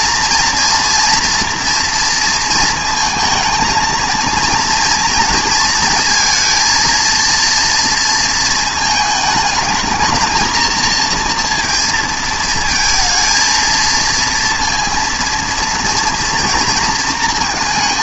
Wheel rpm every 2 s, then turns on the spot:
240, 230, 230, 230, 220, 230, 220, 230, 230.
none